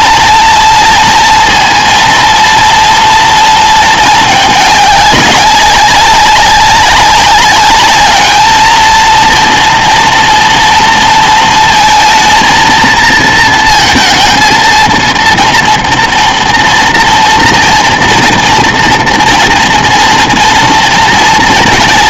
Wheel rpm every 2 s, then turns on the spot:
230, 230, 210, 190, 220, 230, 230, 230, 230, 230, 230.
none